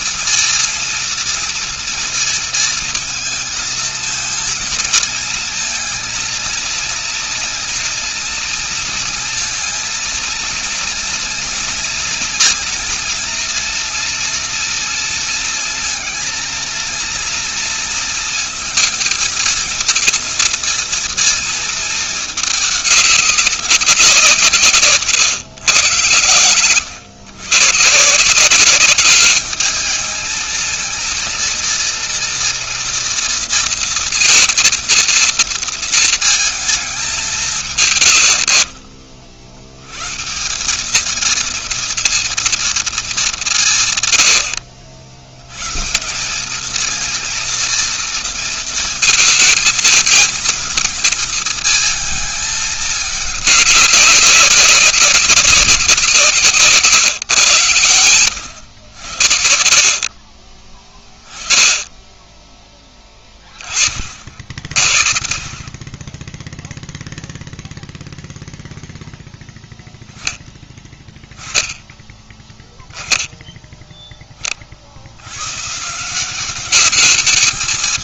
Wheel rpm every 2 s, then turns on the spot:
230, 230, 230, 230, 230, 230, 230, 230, 230, 230, 220, 210, 160, 110, 180, 220, 230, 230, 220, 70, 170, 230, 100, 200, 230, 220, 220, 190, 150, 90, 40, 20, 50, 10, 0, 10, 10, 30, 190.
none